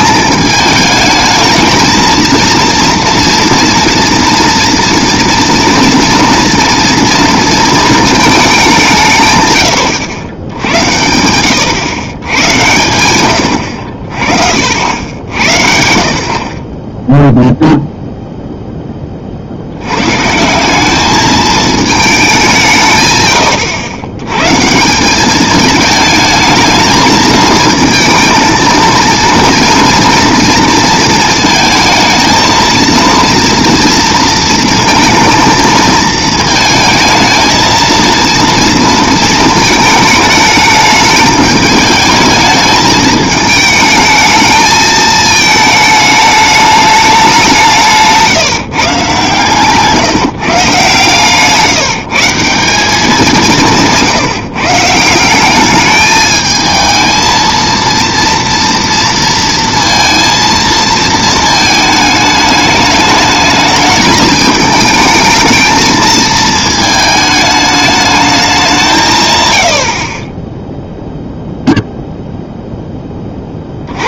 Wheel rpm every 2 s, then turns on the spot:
210, 230, 230, 230, 190, 80, 100, 60, 30, 10, 180, 180, 140, 220, 230, 230, 230, 230, 220, 230, 210, 220, 220, 210, 150, 150, 180, 150, 220, 230, 230, 210, 220, 220, 200, 10, 0.
none